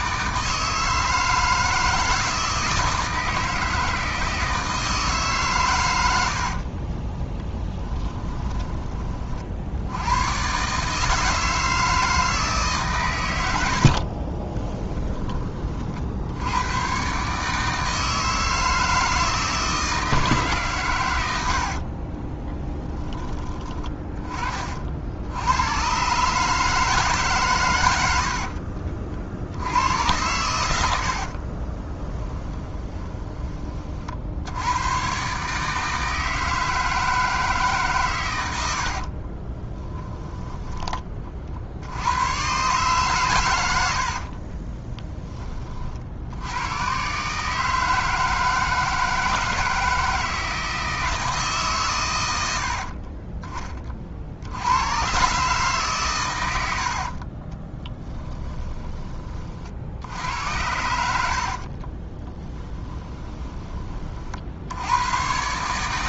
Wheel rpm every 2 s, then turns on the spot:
160, 160, 160, 40, 20, 150, 140, 10, 110, 160, 130, 10, 50, 160, 50, 80, 20, 90, 160, 70, 10, 130, 30, 120, 160, 160, 60, 100, 60, 10, 80, 20, 80.
6-8 14-16 28-30 32-34 44-46 52-54 58-60 62-64